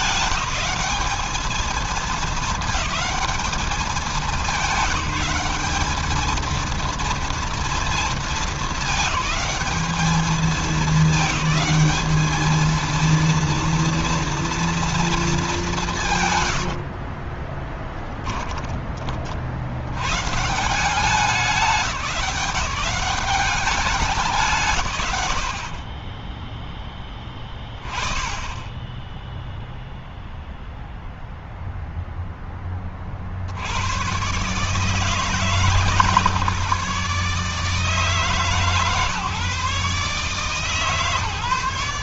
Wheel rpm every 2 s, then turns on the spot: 210, 220, 200, 230, 220, 220, 230, 230, 90, 30, 160, 170, 140, 10, 10, 0, 20, 140, 140, 140, 150.
16-20